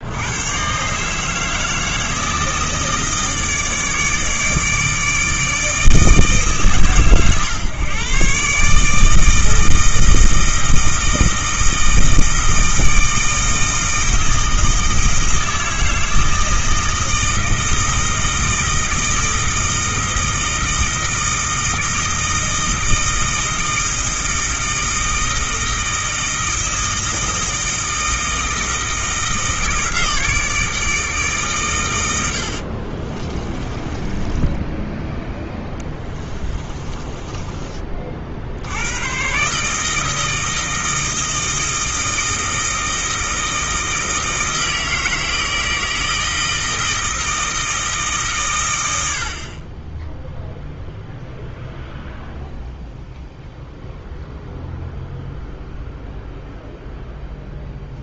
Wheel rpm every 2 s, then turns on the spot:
150, 160, 160, 130, 160, 160, 160, 160, 160, 160, 160, 160, 160, 160, 160, 150, 40, 10, 20, 110, 160, 160, 160, 160, 80, 0, 0, 0, 0.
32-34 36-38